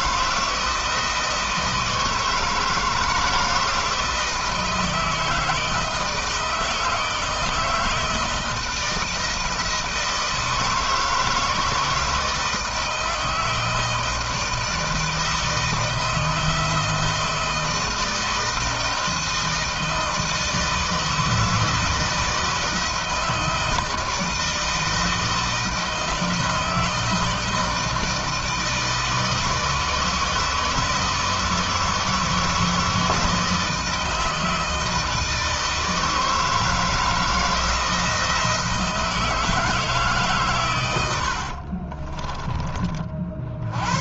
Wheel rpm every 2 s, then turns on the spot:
160, 160, 160, 160, 160, 160, 160, 160, 160, 160, 160, 160, 160, 160, 160, 160, 160, 160, 160, 160, 90, 50.
40-42